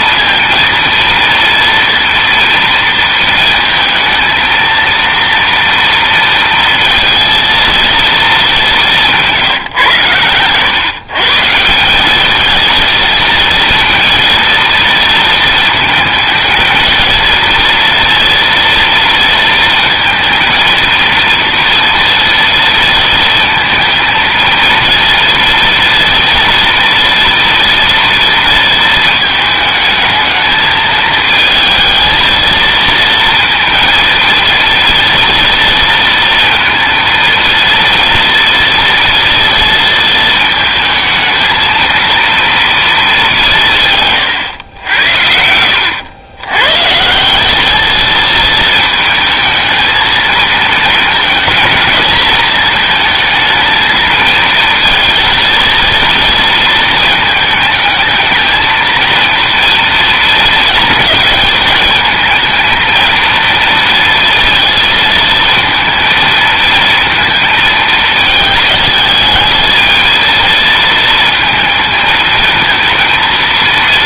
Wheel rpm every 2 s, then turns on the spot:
230, 230, 230, 230, 190, 120, 220, 230, 220, 230, 230, 230, 230, 230, 230, 220, 230, 230, 230, 230, 220, 220, 100, 130, 220, 230, 220, 230, 220, 230, 220, 230, 230, 230, 220, 220, 230.
none